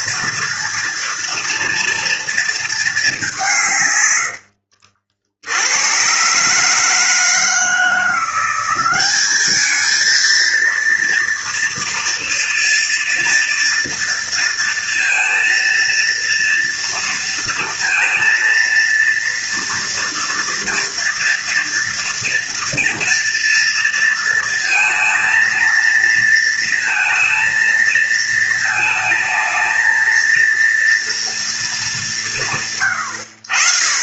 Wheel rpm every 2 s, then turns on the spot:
230, 230, 60, 150, 190, 230, 230, 230, 230, 230, 230, 230, 230, 230, 220, 230, 100.
4-6